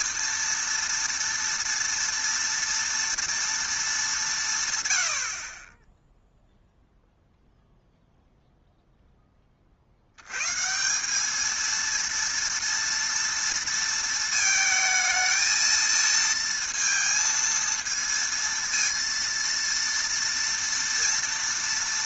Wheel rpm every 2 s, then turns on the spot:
230, 230, 140, 0, 0, 160, 230, 220, 230, 230, 230.
none